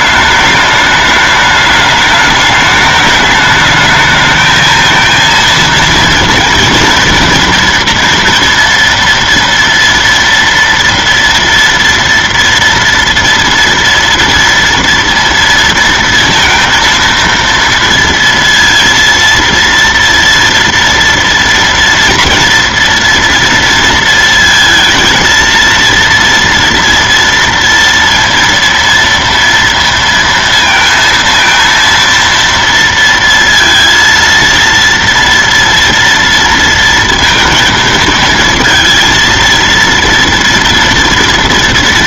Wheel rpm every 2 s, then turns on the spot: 210, 210, 220, 230, 230, 230, 230, 230, 220, 230, 230, 240, 230, 230, 230, 230, 230, 230, 230, 220, 240.
none